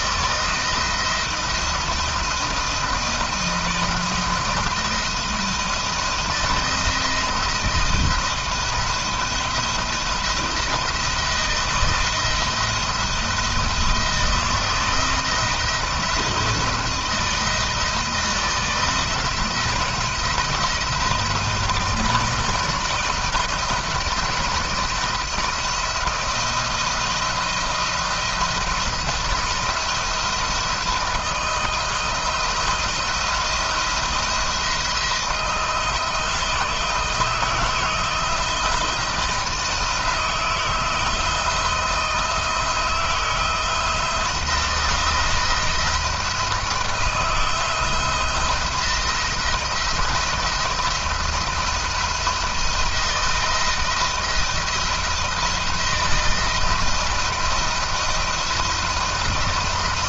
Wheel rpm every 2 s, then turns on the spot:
170, 170, 160, 160, 170, 170, 170, 170, 170, 170, 170, 160, 160, 170, 170, 170, 170, 170, 160, 170, 170, 170, 170, 160, 170, 170, 170, 170, 160, 160.
none